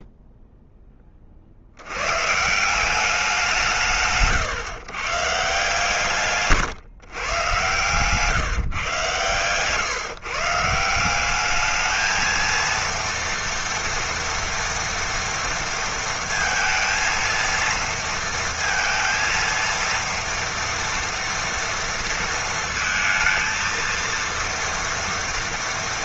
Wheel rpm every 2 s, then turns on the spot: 0, 160, 140, 150, 150, 150, 230, 230, 230, 230, 230, 230, 230.
none